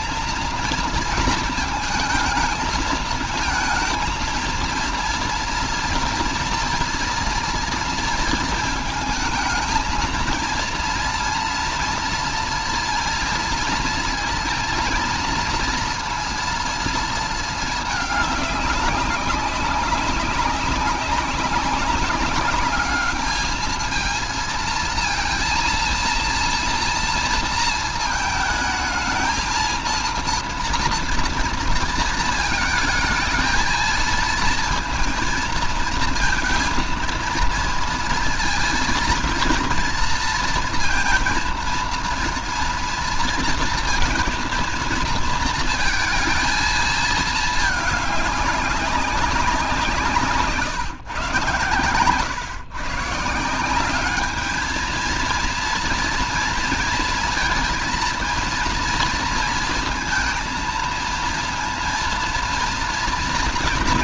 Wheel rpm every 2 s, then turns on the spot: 230, 220, 230, 240, 230, 230, 230, 230, 230, 200, 200, 210, 230, 240, 220, 230, 220, 230, 230, 230, 230, 230, 230, 220, 200, 150, 130, 220, 230, 230, 220, 230.
none